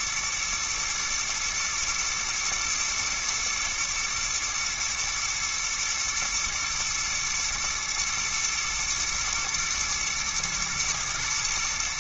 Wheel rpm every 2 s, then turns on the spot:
110, 110, 110, 120, 110, 110.
none